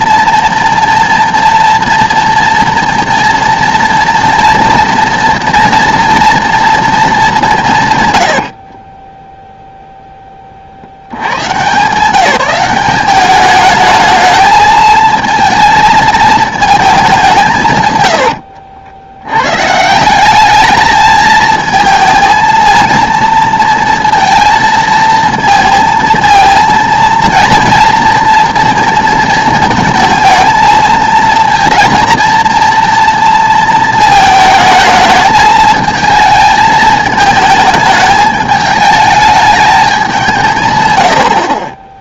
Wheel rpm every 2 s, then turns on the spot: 230, 230, 230, 220, 20, 90, 190, 220, 210, 80, 210, 230, 230, 230, 230, 220, 230, 220, 220, 210, 100.
8-10